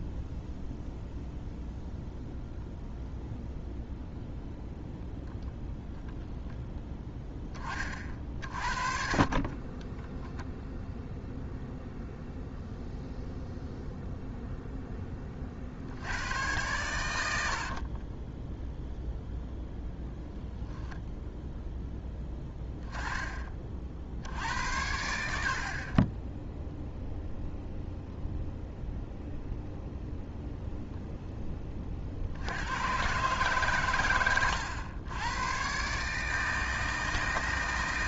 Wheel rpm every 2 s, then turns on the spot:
0, 0, 0, 10, 40, 0, 0, 10, 100, 0, 0, 20, 70, 0, 0, 0, 110, 100, 160.
none